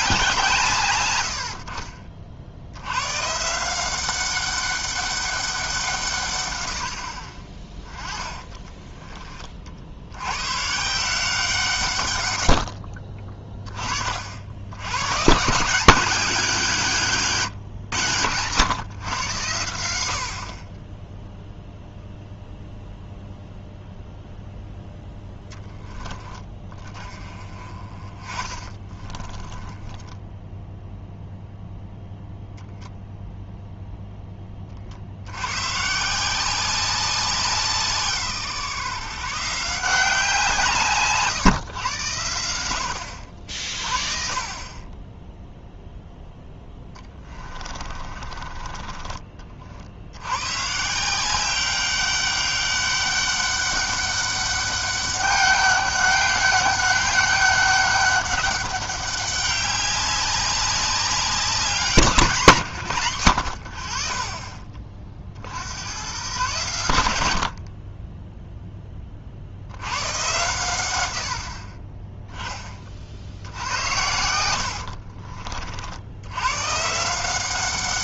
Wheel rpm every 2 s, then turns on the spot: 140, 100, 200, 90, 20, 150, 60, 100, 170, 110, 20, 0, 0, 30, 20, 0, 0, 50, 190, 150, 160, 80, 20, 10, 30, 160, 200, 200, 200, 200, 200, 130, 30, 110, 10, 100, 30, 70, 140.
8-10 28-30 46-50 74-76